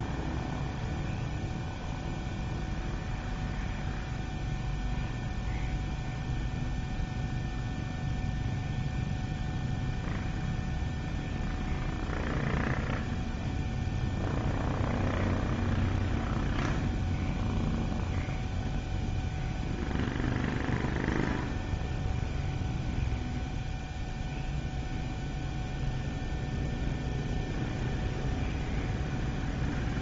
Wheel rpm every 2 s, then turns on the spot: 0, 0, 0, 0, 0, 0, 0, 0, 0, 0, 0, 0, 0, 0, 0.
none